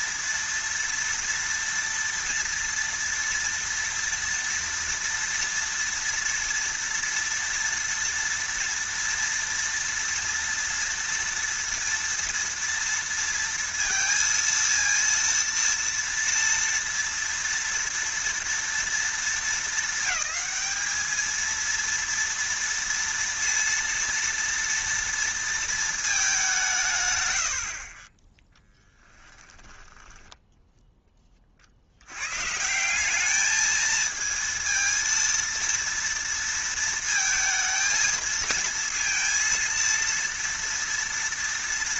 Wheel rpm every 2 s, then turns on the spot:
230, 230, 230, 230, 230, 230, 230, 230, 240, 230, 220, 230, 230, 160, 10, 10, 170, 230, 230, 230, 230.
28-30